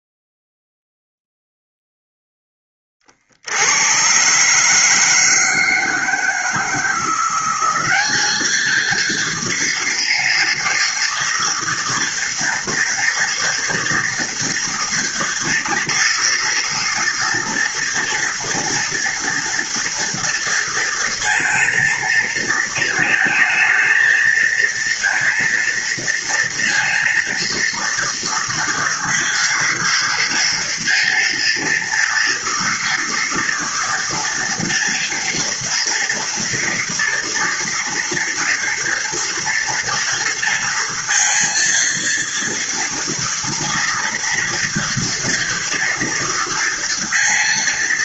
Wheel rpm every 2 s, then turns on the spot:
0, 50, 160, 180, 230, 230, 230, 230, 230, 230, 230, 220, 230, 230, 230, 230, 230, 230, 230, 230, 230, 230, 230, 230.
none